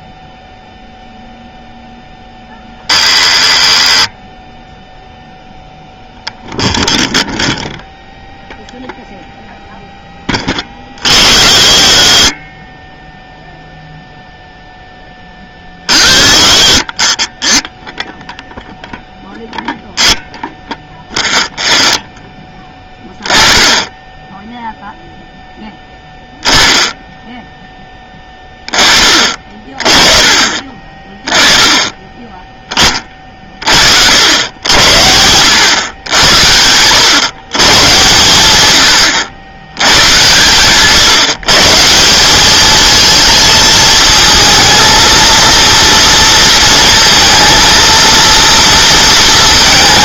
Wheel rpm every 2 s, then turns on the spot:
0, 0, 0, 0, 0, 40, 20, 0, 30, 0, 0, 10, 0, 10, 20, 20, 20, 100, 100, 100, 130, 210, 230, 230, 230.
none